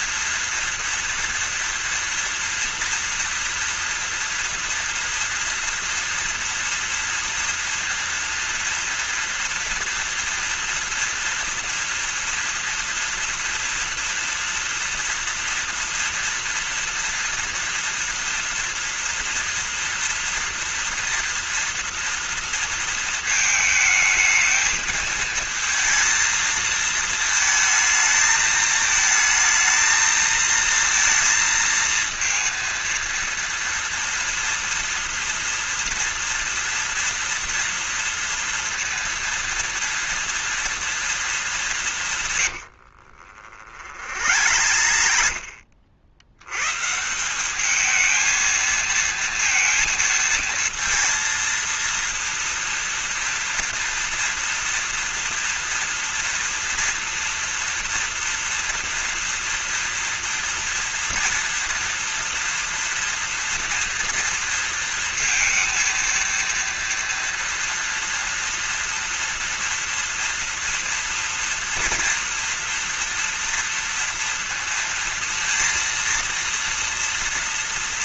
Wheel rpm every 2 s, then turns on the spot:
230, 230, 230, 230, 230, 230, 230, 240, 230, 230, 230, 230, 220, 220, 220, 230, 230, 230, 230, 230, 230, 120, 70, 110, 220, 230, 230, 230, 240, 240, 230, 230, 230, 230, 230, 230, 230, 230, 230.
42-46